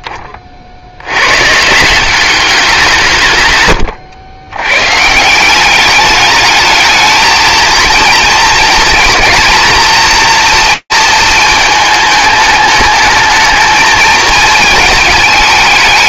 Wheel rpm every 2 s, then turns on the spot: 10, 190, 110, 210, 230, 230, 210, 220.
none